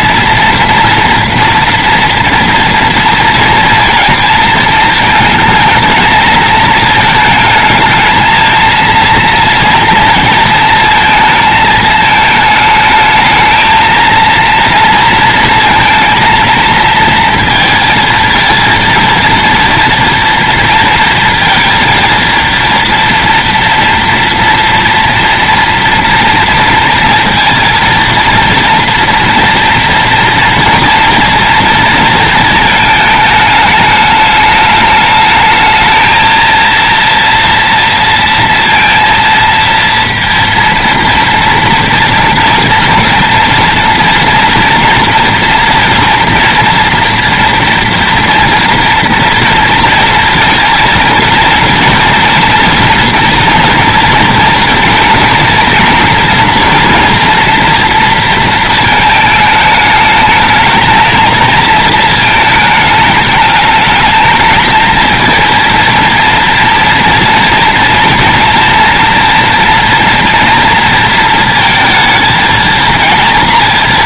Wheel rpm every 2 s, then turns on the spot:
240, 230, 220, 220, 230, 230, 220, 230, 230, 230, 230, 230, 230, 230, 230, 230, 220, 210, 230, 230, 230, 240, 230, 230, 230, 230, 230, 230, 240, 220, 220, 210, 220, 230, 230, 230, 230.
none